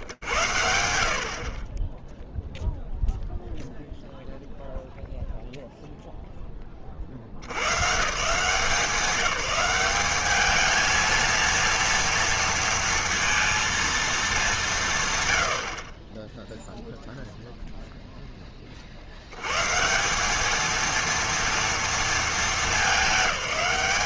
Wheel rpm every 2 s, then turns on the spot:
50, 0, 0, 120, 190, 230, 230, 90, 0, 80, 230, 210.
none